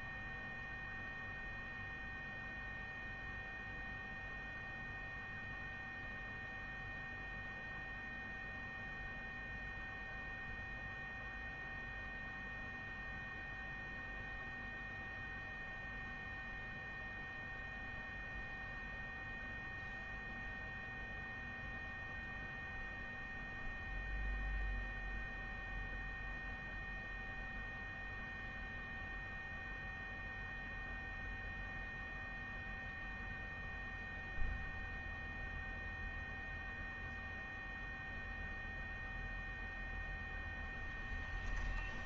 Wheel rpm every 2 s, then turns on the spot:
0, 0, 0, 0, 0, 0, 0, 0, 0, 0, 0, 0, 0, 0, 0, 0, 0, 0, 0, 0, 0.
none